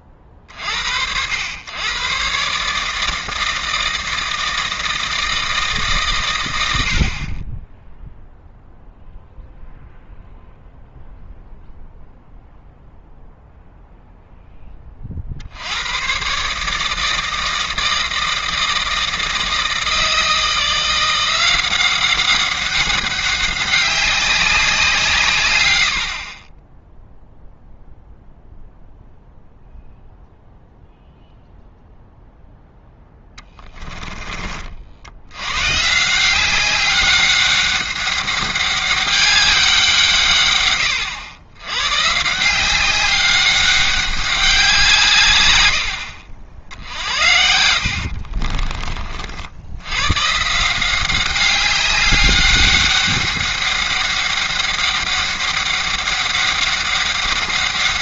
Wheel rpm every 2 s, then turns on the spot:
40, 140, 160, 100, 0, 0, 0, 10, 150, 160, 170, 190, 190, 10, 0, 0, 10, 40, 200, 200, 120, 180, 190, 70, 30, 160, 200, 200, 200.
48-50